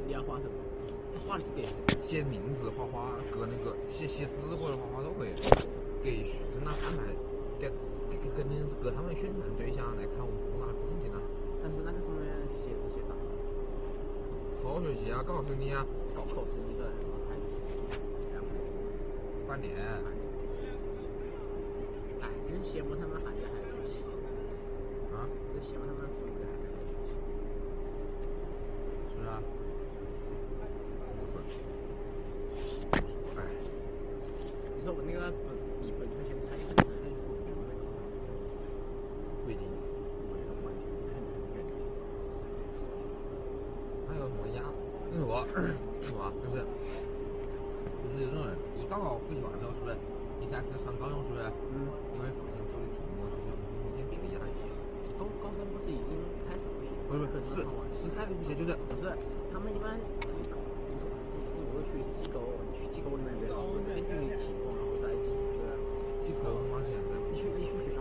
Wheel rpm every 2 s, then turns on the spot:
0, 0, 0, 0, 0, 0, 0, 0, 0, 0, 0, 0, 0, 0, 0, 0, 0, 0, 0, 0, 0, 0, 0, 0, 0, 0, 0, 0, 0, 0, 0, 0, 0, 0.
none